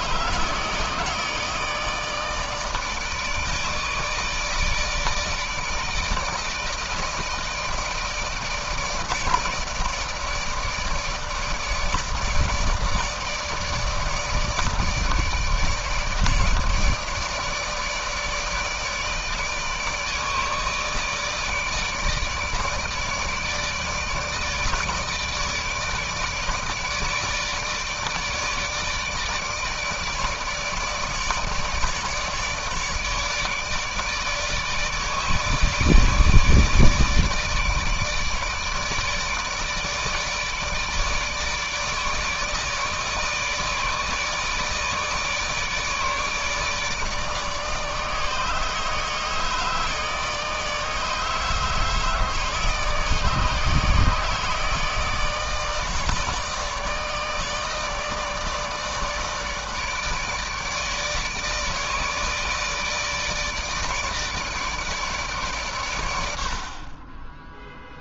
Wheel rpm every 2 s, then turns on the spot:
150, 160, 160, 160, 160, 150, 150, 150, 160, 150, 150, 150, 160, 150, 150, 150, 150, 150, 160, 150, 160, 150, 160, 150, 150, 150, 150, 160, 160, 160, 150, 160, 150, 50.
none